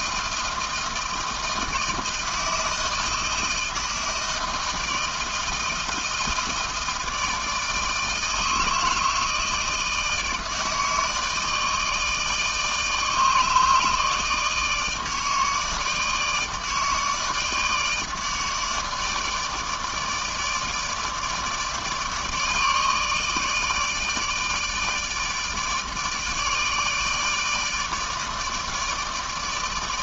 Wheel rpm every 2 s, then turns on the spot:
160, 160, 160, 160, 160, 160, 160, 160, 150, 160, 160, 150, 150, 160, 150.
none